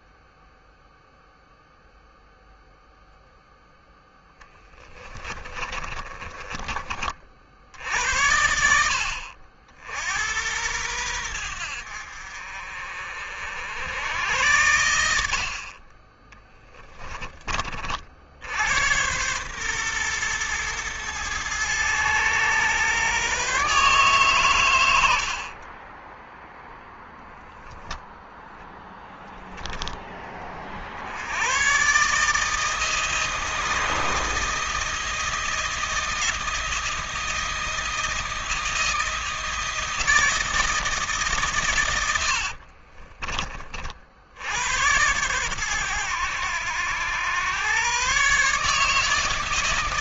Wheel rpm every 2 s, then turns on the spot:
0, 0, 20, 40, 60, 90, 60, 60, 30, 110, 110, 130, 70, 0, 0, 70, 160, 160, 160, 160, 160, 40, 100, 100, 150.
4-6 42-44